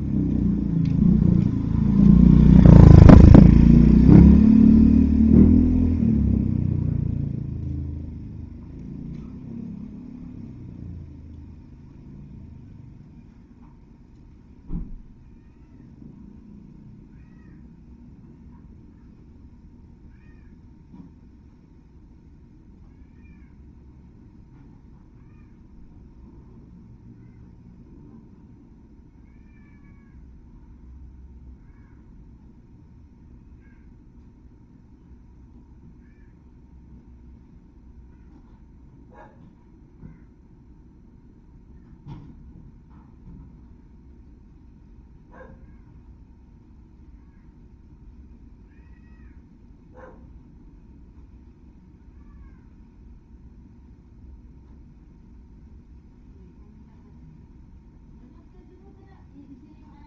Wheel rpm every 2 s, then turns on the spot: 0, 0, 0, 0, 0, 0, 0, 0, 0, 0, 0, 0, 0, 0, 0, 0, 0, 0, 0, 0, 0, 0, 0, 0, 0, 0, 0, 0, 0, 0.
none